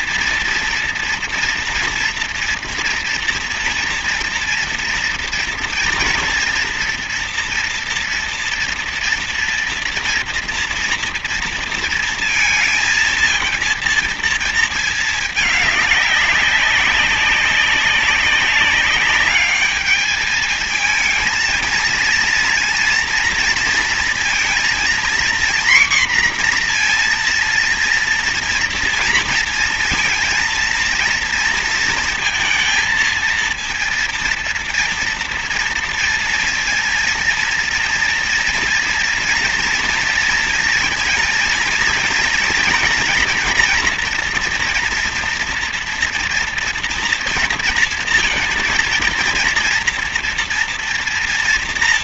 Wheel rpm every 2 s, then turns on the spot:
230, 230, 230, 230, 240, 230, 230, 220, 200, 200, 220, 230, 240, 240, 230, 230, 230, 230, 230, 230, 230, 240, 230, 230, 230, 240.
none